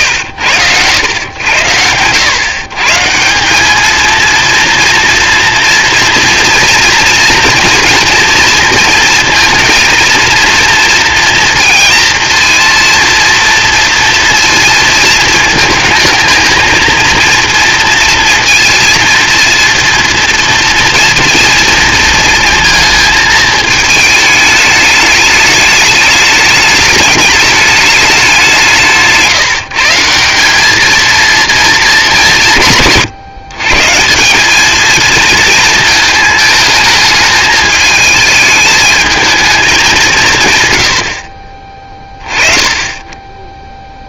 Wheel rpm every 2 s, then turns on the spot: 100, 140, 230, 230, 230, 230, 230, 230, 220, 230, 230, 230, 210, 210, 170, 210, 150, 220, 220, 210, 90, 20.
none